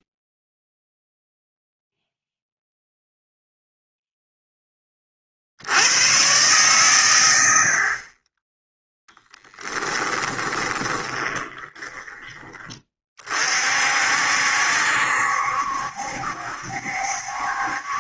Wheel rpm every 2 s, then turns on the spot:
0, 0, 10, 120, 10, 20, 20, 70, 70.
10-12